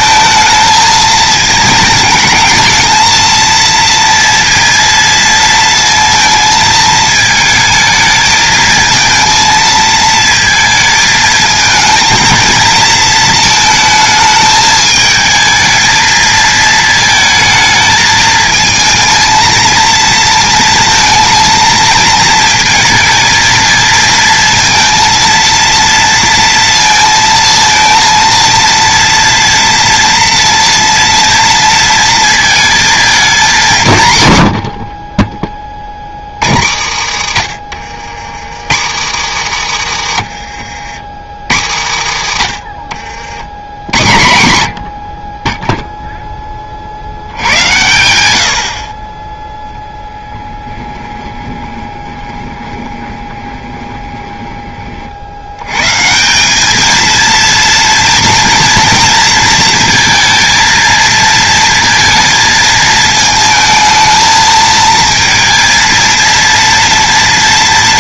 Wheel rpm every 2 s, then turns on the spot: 220, 230, 230, 220, 220, 220, 230, 220, 220, 230, 230, 230, 230, 230, 230, 230, 220, 40, 90, 110, 70, 50, 50, 60, 40, 10, 20, 40, 220, 230, 230, 220, 220, 230.
34-36 50-54